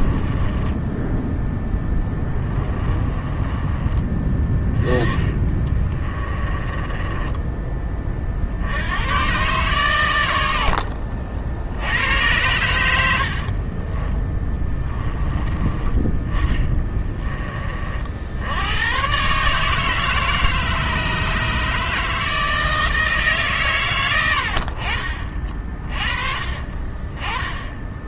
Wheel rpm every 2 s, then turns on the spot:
10, 20, 20, 10, 90, 70, 80, 20, 20, 110, 150, 160, 60, 30.
0-8 10-12 16-18 26-28